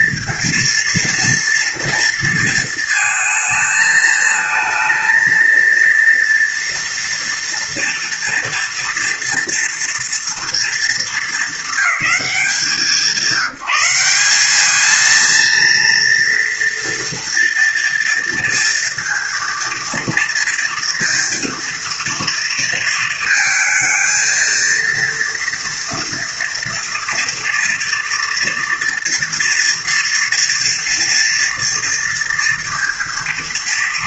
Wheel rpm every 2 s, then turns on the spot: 230, 230, 220, 230, 230, 220, 180, 210, 230, 230, 230, 230, 230, 230, 240, 230, 230.
none